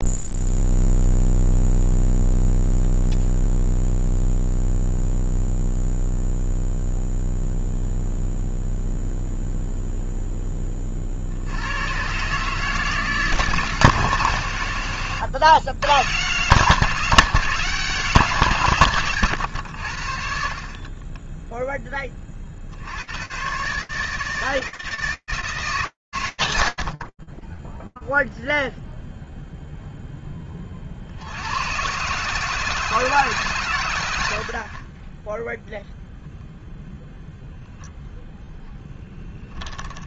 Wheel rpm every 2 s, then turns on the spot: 0, 0, 0, 0, 0, 20, 160, 120, 180, 160, 30, 90, 160, 100, 0, 40, 160, 20, 0, 10.
none